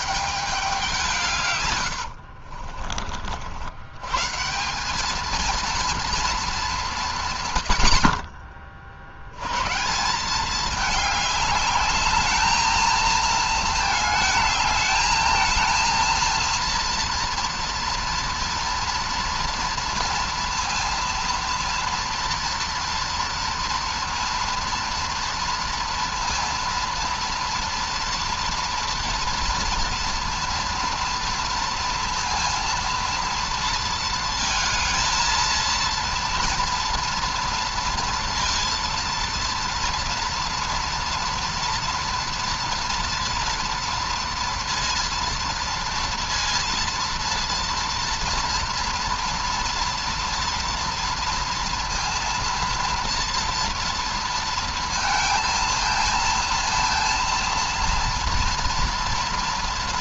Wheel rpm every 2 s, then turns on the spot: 200, 50, 150, 220, 50, 190, 220, 220, 230, 240, 230, 230, 230, 230, 240, 230, 230, 230, 230, 230, 230, 230, 230, 230, 230, 230, 230, 230, 230, 230.
2-4